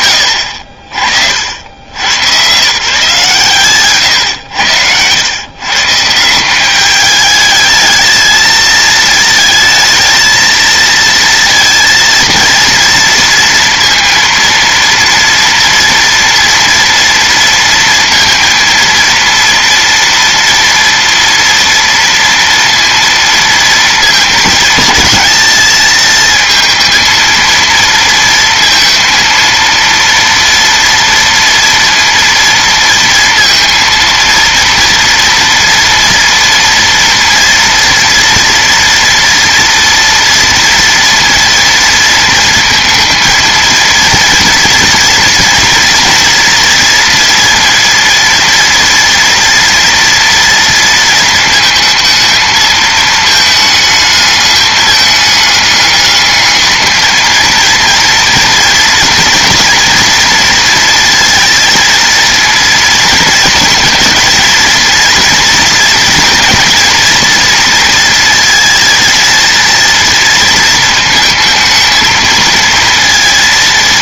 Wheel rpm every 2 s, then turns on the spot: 60, 140, 120, 210, 220, 230, 230, 230, 230, 230, 230, 230, 220, 230, 230, 230, 230, 230, 230, 230, 230, 230, 240, 230, 230, 230, 220, 210, 220, 230, 230, 230, 230, 230, 220, 220, 230.
none